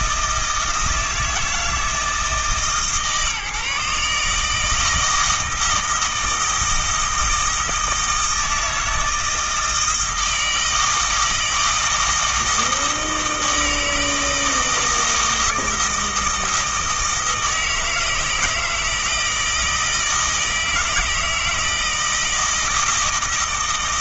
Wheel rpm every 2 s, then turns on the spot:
160, 150, 160, 160, 160, 160, 160, 160, 160, 160, 160, 160.
none